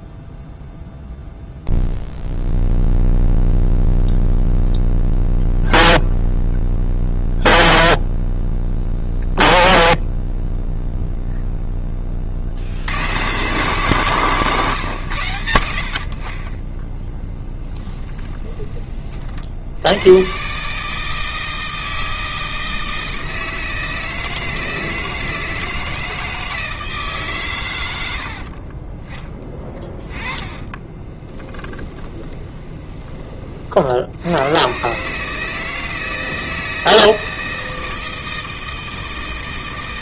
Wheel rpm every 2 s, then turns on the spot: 0, 0, 0, 0, 0, 0, 150, 80, 10, 80, 160, 160, 160, 100, 10, 20, 60, 160, 160, 160.
16-18 28-32